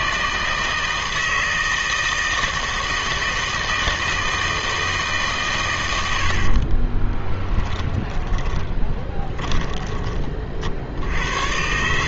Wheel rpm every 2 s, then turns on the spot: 160, 160, 160, 30, 20, 60.
6-10